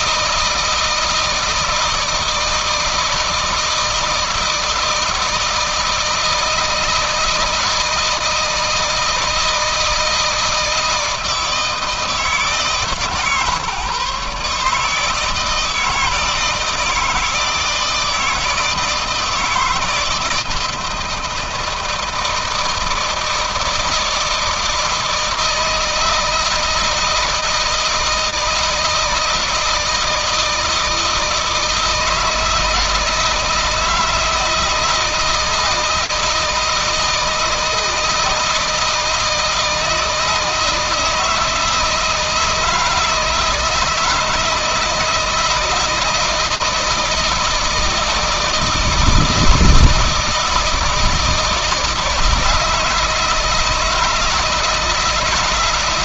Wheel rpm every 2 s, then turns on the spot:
160, 160, 160, 160, 160, 160, 150, 140, 170, 160, 160, 160, 160, 160, 160, 160, 160, 160, 160, 160, 160, 160, 160, 160, 160, 160, 160, 160.
none